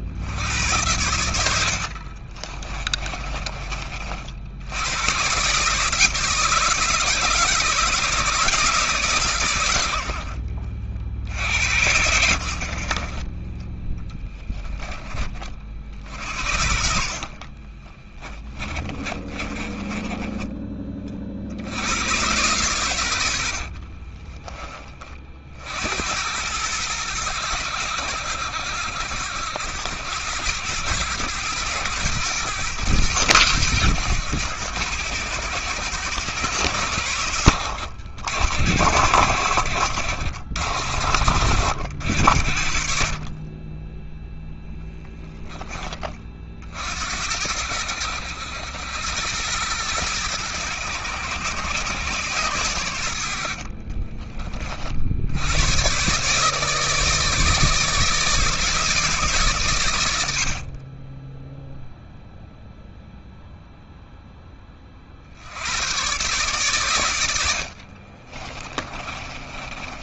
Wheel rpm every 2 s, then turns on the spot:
90, 30, 120, 160, 140, 60, 40, 20, 50, 20, 40, 100, 30, 100, 80, 100, 110, 100, 90, 90, 70, 40, 10, 70, 90, 100, 80, 60, 150, 160, 30, 0, 50, 110, 20.
0-4 12-14 16-20 22-24 66-70